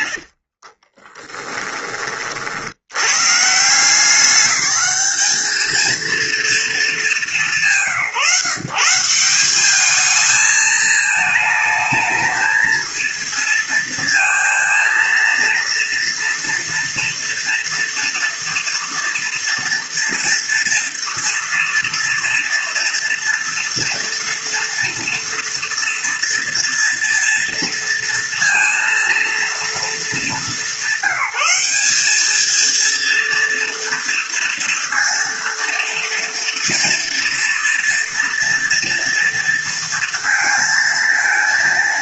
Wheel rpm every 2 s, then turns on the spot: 40, 110, 210, 210, 160, 220, 230, 230, 240, 230, 240, 230, 230, 230, 230, 190, 230, 230, 230, 230, 230.
0-2